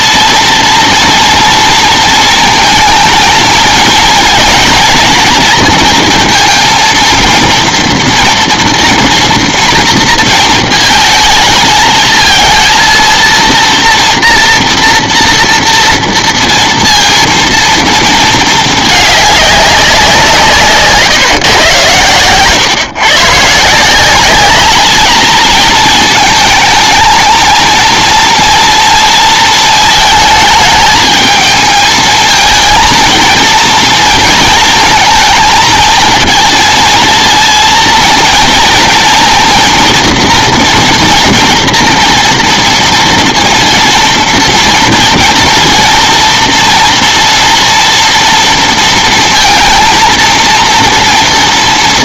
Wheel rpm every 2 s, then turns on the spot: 230, 220, 220, 230, 230, 220, 230, 240, 230, 220, 150, 130, 210, 220, 240, 220, 230, 230, 230, 230, 240, 230, 230, 240, 230, 230.
none